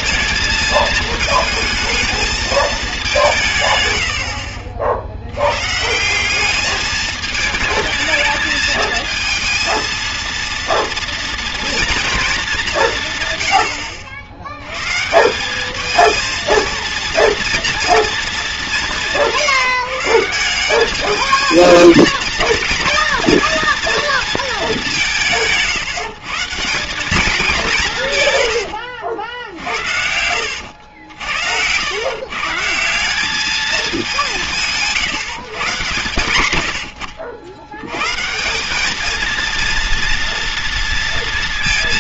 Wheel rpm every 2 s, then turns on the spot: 220, 210, 60, 220, 220, 230, 180, 110, 230, 200, 200, 230, 200, 190, 80, 90, 180, 150, 80, 200, 230.
28-32